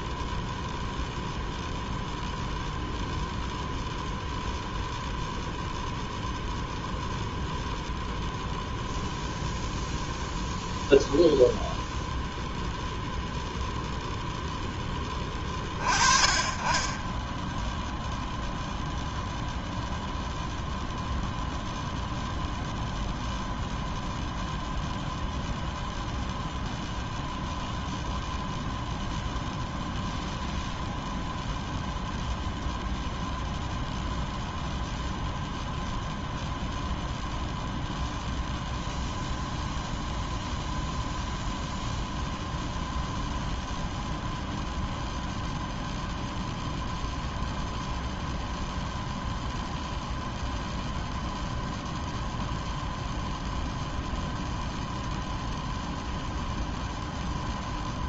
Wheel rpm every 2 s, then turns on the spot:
0, 0, 0, 0, 0, 0, 0, 10, 20, 0, 0, 0, 0, 0, 0, 0, 0, 0, 0, 0, 0, 0, 0, 0, 0, 0, 0, 0, 0.
none